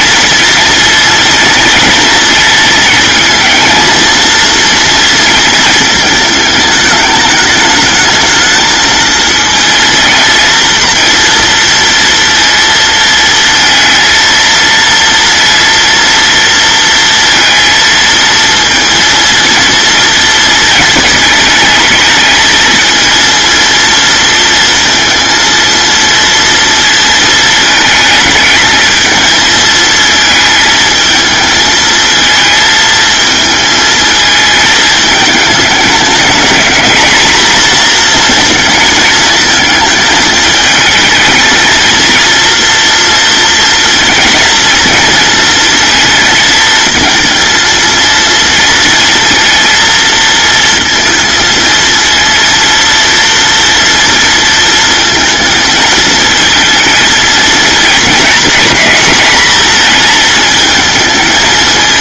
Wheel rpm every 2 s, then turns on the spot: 230, 230, 230, 210, 230, 230, 230, 230, 230, 230, 220, 230, 230, 230, 220, 220, 220, 220, 210, 230, 220, 230, 230, 230, 230, 230, 230, 230, 220, 230, 220.
none